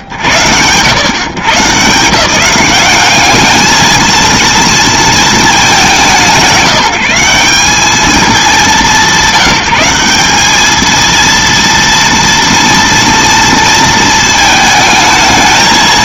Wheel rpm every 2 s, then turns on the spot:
90, 160, 230, 180, 190, 220, 230, 220.
none